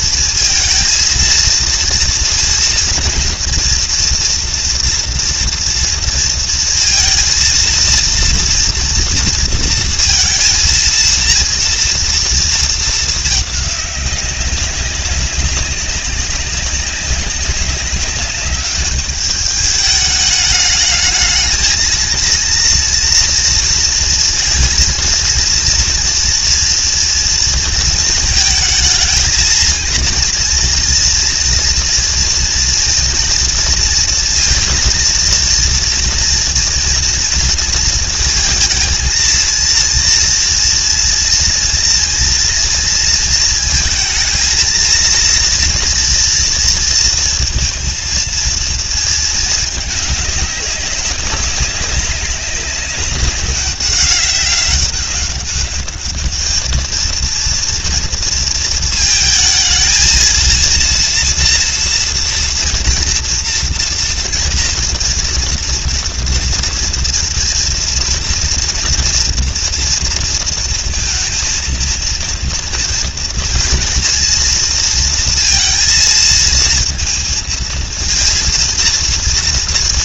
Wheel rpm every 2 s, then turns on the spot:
230, 230, 230, 230, 230, 230, 220, 200, 190, 200, 210, 230, 230, 230, 220, 240, 230, 230, 230, 220, 230, 230, 230, 230, 230, 200, 200, 190, 220, 230, 230, 230, 230, 230, 230, 230, 230, 230, 230, 230.
none